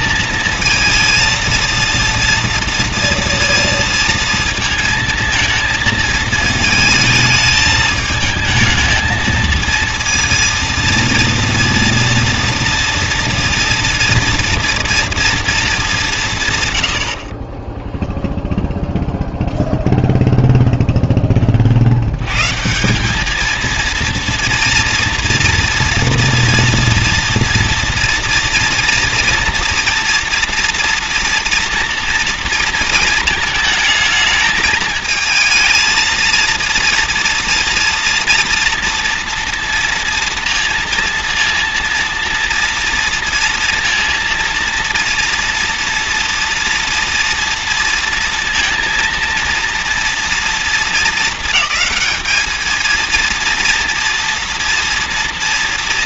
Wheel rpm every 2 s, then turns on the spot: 220, 230, 220, 220, 220, 230, 230, 230, 120, 0, 0, 150, 230, 230, 230, 240, 230, 220, 240, 230, 230, 230, 230, 230, 230, 230, 220, 230.
none